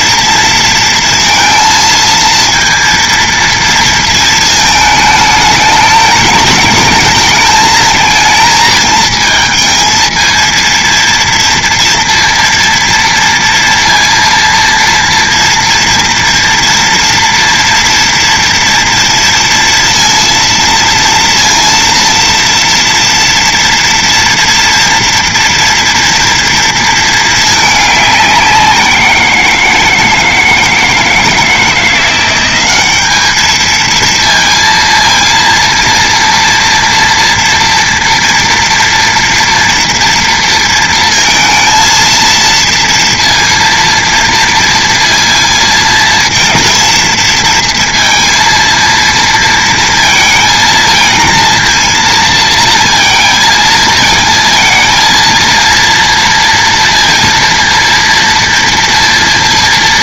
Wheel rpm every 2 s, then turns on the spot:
230, 230, 220, 210, 230, 230, 230, 230, 230, 230, 230, 230, 230, 230, 190, 160, 200, 230, 230, 230, 230, 230, 230, 230, 230, 220, 230, 230, 230, 230.
none